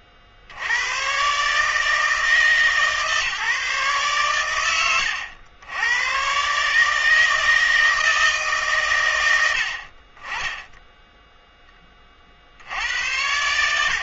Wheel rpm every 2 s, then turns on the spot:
90, 150, 90, 150, 150, 20, 60.
none